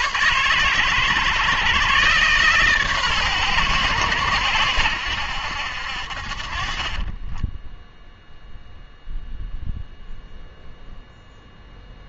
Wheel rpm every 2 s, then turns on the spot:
120, 130, 90, 30, 0, 0.
6-8